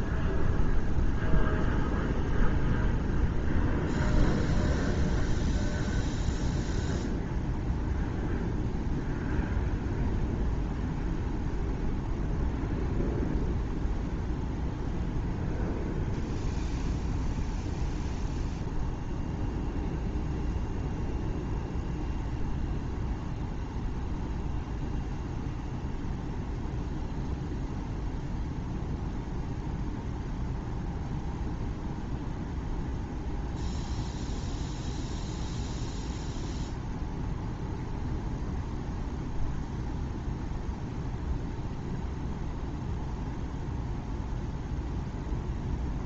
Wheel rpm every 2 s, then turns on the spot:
0, 0, 0, 0, 0, 0, 0, 0, 0, 0, 0, 0, 0, 0, 0, 0, 0, 0, 0, 0, 0, 0, 0.
none